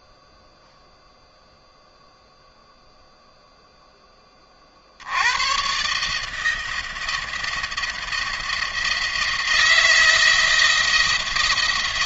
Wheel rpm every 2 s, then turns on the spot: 0, 0, 60, 160, 160, 170.
none